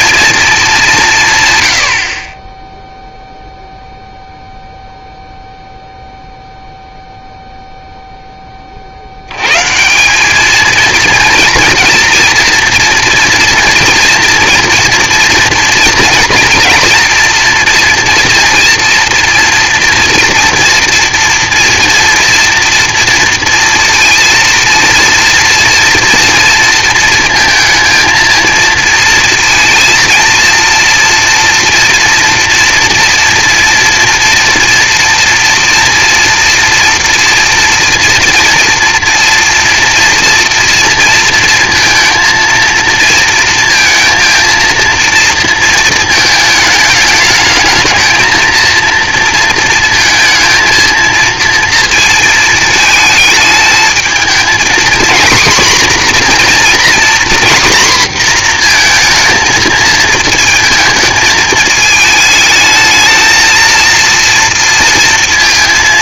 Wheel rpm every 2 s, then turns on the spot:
200, 10, 0, 0, 40, 230, 230, 230, 230, 240, 240, 230, 230, 230, 230, 230, 230, 230, 230, 240, 230, 230, 230, 220, 230, 230, 220, 240, 240, 230, 220, 220, 230.
none